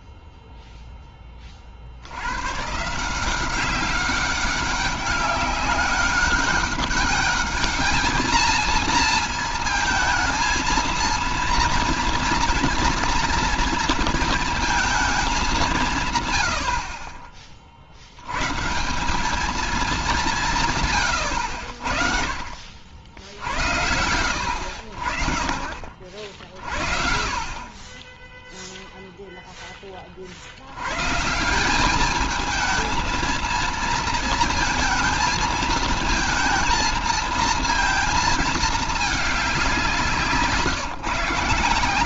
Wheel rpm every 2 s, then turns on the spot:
0, 110, 200, 200, 220, 220, 230, 230, 130, 110, 180, 40, 90, 60, 10, 50, 210, 230, 220, 220, 160.
none